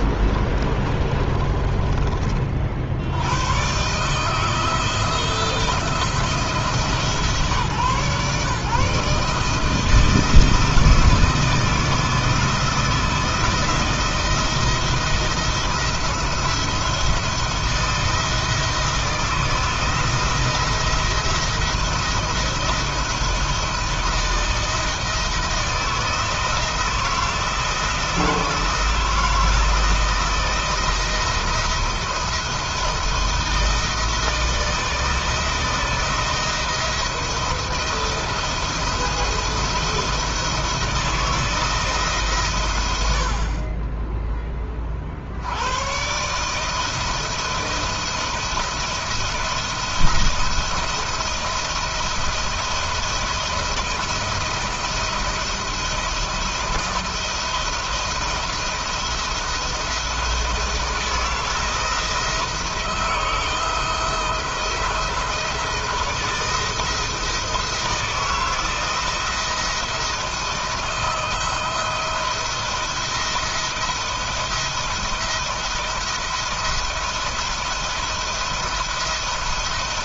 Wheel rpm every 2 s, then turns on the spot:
30, 80, 170, 150, 150, 160, 160, 170, 170, 170, 170, 170, 160, 160, 160, 160, 160, 170, 170, 170, 160, 80, 50, 160, 170, 170, 170, 170, 170, 170, 170, 170, 170, 170, 170, 160, 170, 170, 170, 160.
0-2